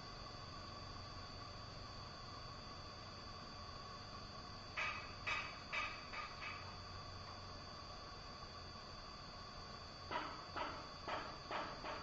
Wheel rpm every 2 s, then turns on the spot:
0, 0, 0, 0, 0, 0.
none